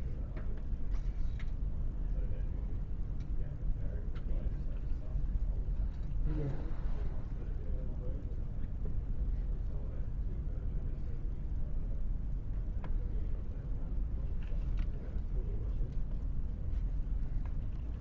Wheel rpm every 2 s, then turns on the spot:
0, 0, 0, 0, 0, 0, 0, 0, 0.
none